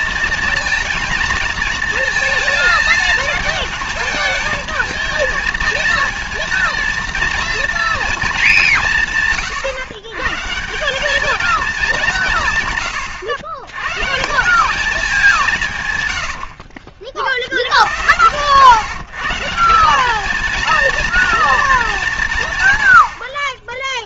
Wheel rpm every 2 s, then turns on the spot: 230, 220, 220, 230, 170, 180, 120, 200, 70, 130, 230, 110.
none